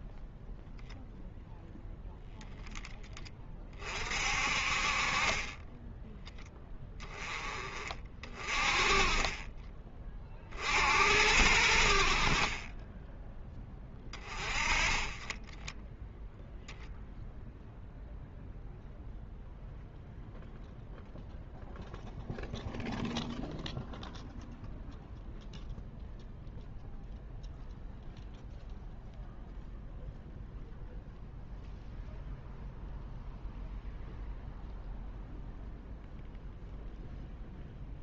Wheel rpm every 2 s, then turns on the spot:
0, 10, 40, 10, 30, 60, 20, 20, 0, 0, 0, 0, 0, 0, 0, 0, 0, 0, 0.
12-14